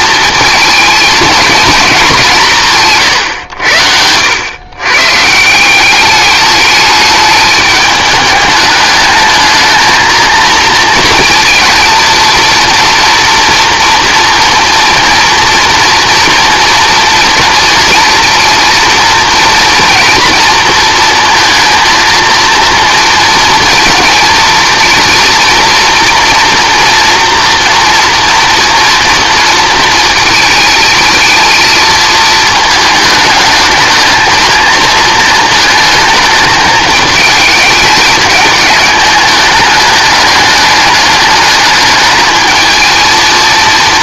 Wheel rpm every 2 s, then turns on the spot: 220, 150, 120, 210, 210, 230, 230, 240, 230, 230, 230, 230, 230, 230, 230, 220, 220, 220, 220, 210, 210, 220.
none